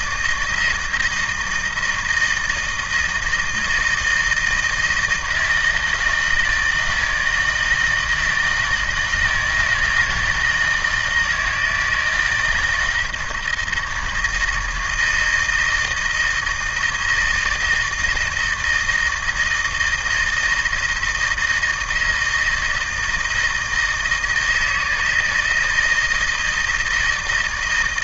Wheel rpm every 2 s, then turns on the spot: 160, 160, 160, 160, 160, 160, 170, 160, 160, 160, 160, 160, 160, 160.
none